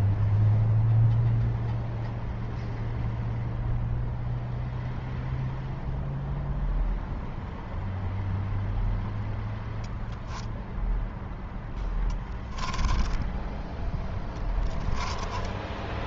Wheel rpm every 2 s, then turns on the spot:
0, 0, 0, 0, 0, 0, 10, 10.
12-16